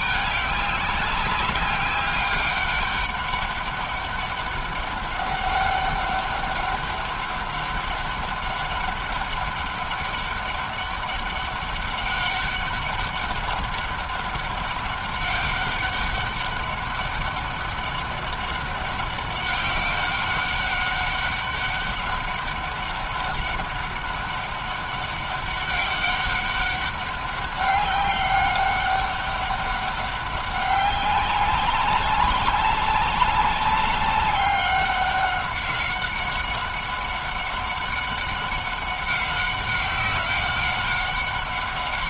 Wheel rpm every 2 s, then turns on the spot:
190, 200, 200, 200, 200, 200, 200, 200, 200, 200, 200, 200, 200, 200, 200, 190, 200, 200, 190, 190, 200.
none